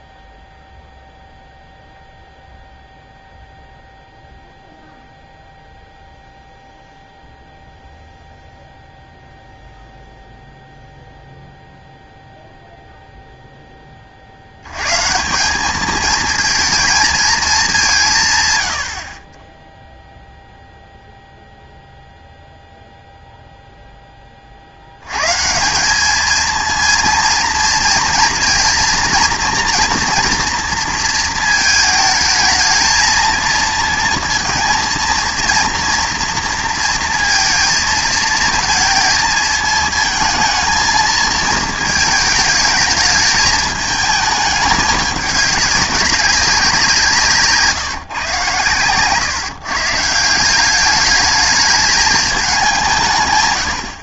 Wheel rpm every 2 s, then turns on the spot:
0, 0, 0, 0, 0, 0, 0, 110, 220, 110, 0, 0, 70, 230, 230, 230, 220, 230, 230, 230, 220, 220, 210, 180, 120, 190, 190.
none